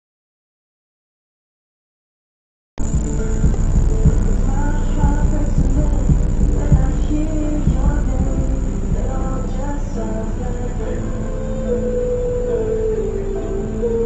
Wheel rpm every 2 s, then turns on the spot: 0, 0, 0, 0, 0, 0, 0.
none